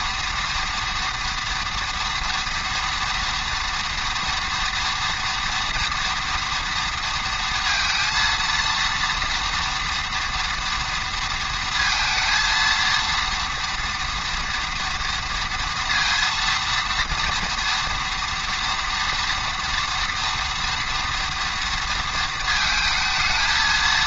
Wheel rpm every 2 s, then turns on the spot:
230, 230, 230, 230, 230, 230, 230, 230, 230, 240, 230, 220.
none